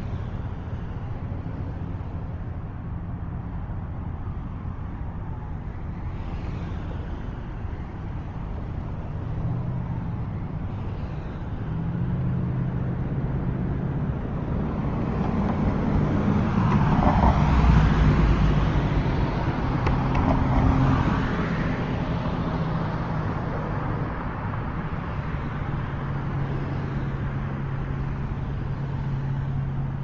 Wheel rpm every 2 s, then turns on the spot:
0, 0, 0, 0, 0, 0, 0, 0, 0, 0, 0, 0, 0, 0, 0.
none